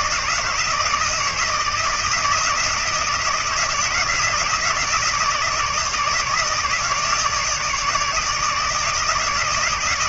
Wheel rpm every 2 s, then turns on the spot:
160, 170, 160, 160, 160.
none